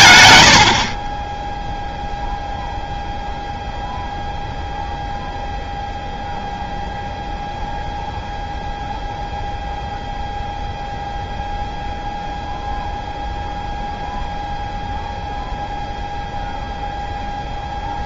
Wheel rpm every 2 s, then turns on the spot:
60, 0, 0, 0, 0, 0, 0, 0, 0.
0-2